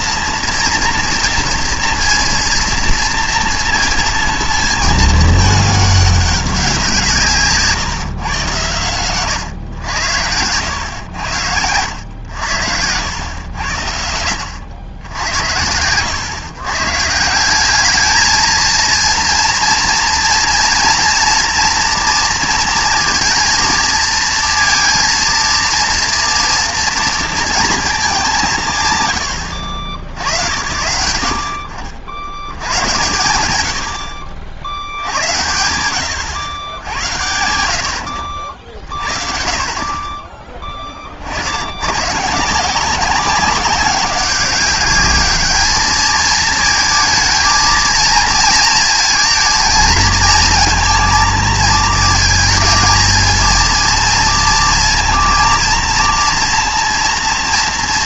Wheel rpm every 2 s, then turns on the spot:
230, 230, 220, 180, 110, 100, 80, 80, 120, 220, 230, 230, 230, 230, 170, 90, 90, 70, 90, 50, 20, 170, 200, 220, 220, 230, 220, 230, 230.
none